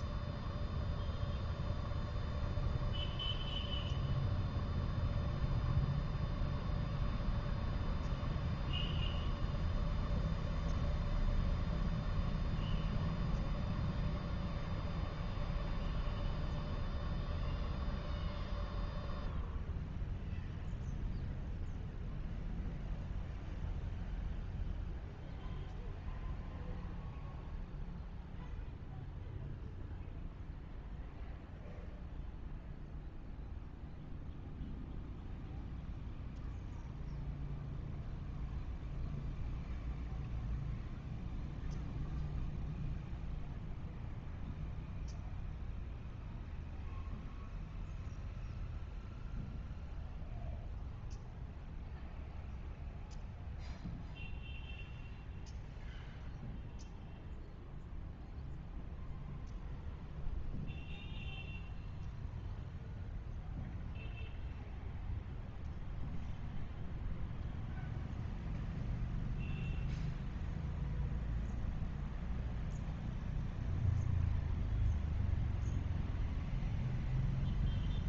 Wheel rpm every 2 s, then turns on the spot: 0, 0, 0, 0, 0, 0, 0, 0, 0, 0, 0, 0, 0, 0, 0, 0, 0, 0, 0, 0, 0, 0, 0, 0, 0, 0, 0, 0, 0, 0, 0, 0, 0, 0, 0, 0, 0, 0, 0.
none